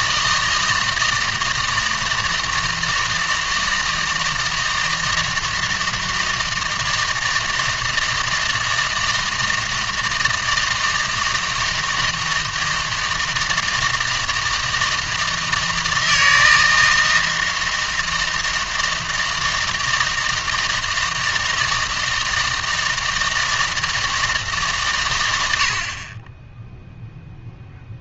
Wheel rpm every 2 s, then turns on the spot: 160, 160, 160, 160, 160, 160, 160, 160, 160, 160, 160, 160, 140, 0.
none